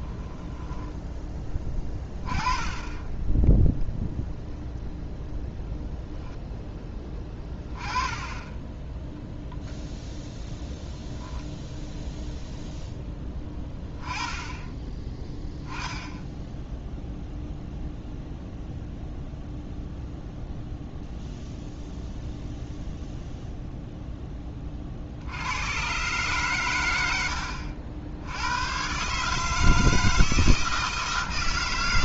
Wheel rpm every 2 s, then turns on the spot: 10, 10, 0, 10, 20, 0, 0, 10, 10, 0, 0, 0, 30, 120, 100, 160.
0-2